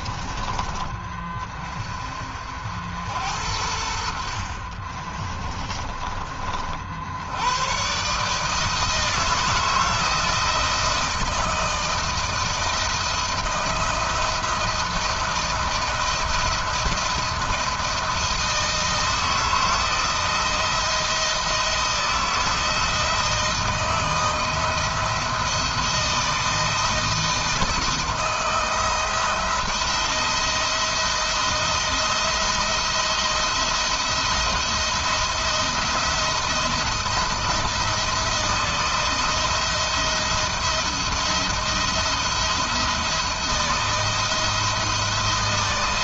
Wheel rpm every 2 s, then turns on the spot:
20, 70, 30, 70, 160, 160, 160, 170, 170, 160, 170, 160, 170, 160, 170, 170, 170, 170, 170, 160, 170, 170, 160.
4-6